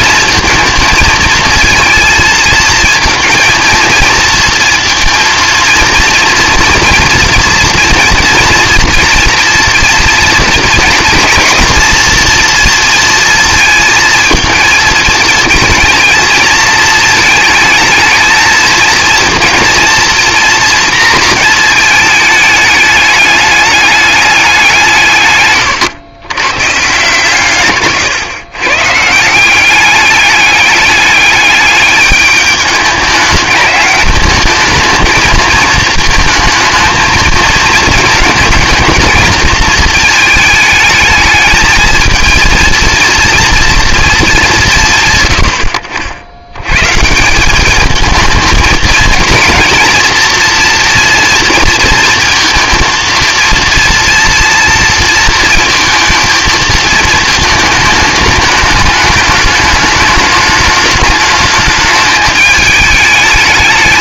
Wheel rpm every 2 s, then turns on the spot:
230, 230, 230, 240, 240, 230, 230, 220, 220, 230, 230, 210, 170, 130, 130, 200, 210, 220, 220, 220, 220, 220, 170, 110, 220, 230, 230, 230, 230, 210, 210, 210.
none